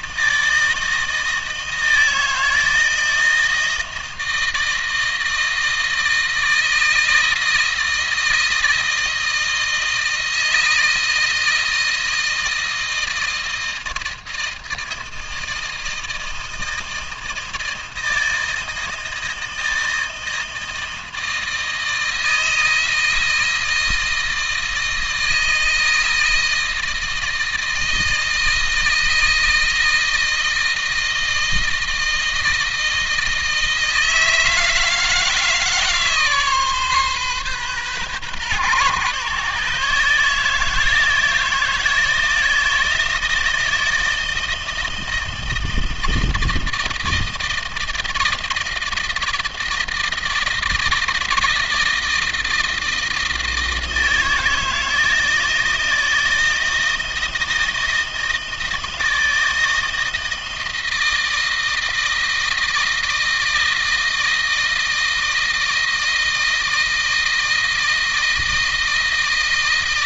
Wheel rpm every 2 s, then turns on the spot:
160, 160, 160, 160, 160, 160, 160, 160, 160, 160, 160, 160, 160, 160, 160, 160, 160, 160, 140, 140, 160, 160, 160, 160, 160, 160, 160, 160, 160, 160, 160, 160, 160, 160, 160.
none